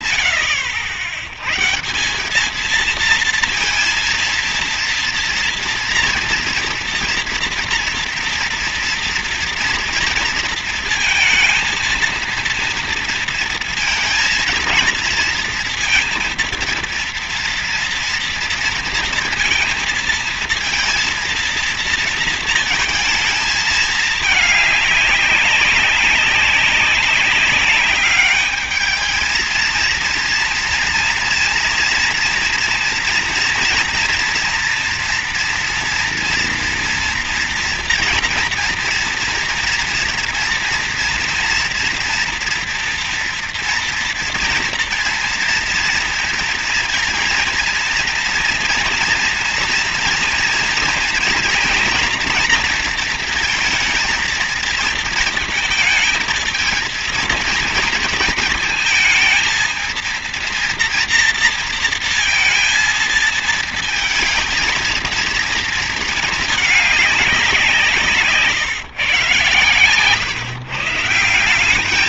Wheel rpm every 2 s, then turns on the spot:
90, 200, 230, 230, 230, 230, 230, 230, 230, 230, 230, 220, 220, 190, 210, 230, 230, 230, 230, 230, 230, 230, 230, 230, 230, 230, 230, 230, 230, 220, 230, 230, 220, 220, 160, 130.
none